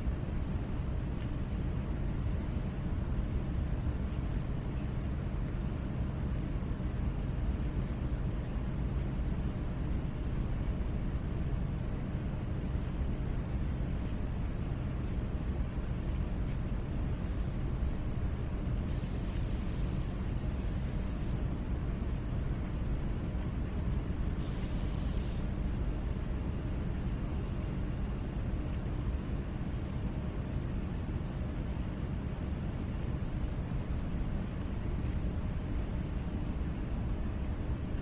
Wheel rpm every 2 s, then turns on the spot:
0, 0, 0, 0, 0, 0, 0, 0, 0, 0, 0, 0, 0, 0, 0, 0, 0, 0, 0.
none